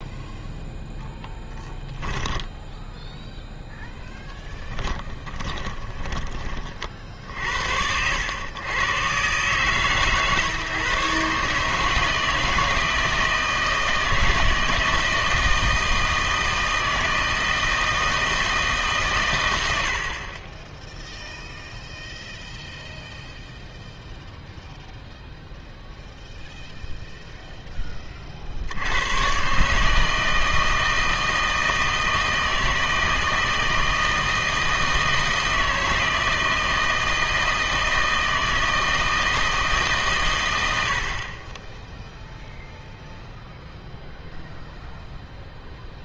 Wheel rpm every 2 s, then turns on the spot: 0, 10, 10, 30, 100, 140, 160, 160, 160, 160, 20, 0, 0, 0, 60, 160, 160, 160, 160, 160, 100, 0, 0.
2-6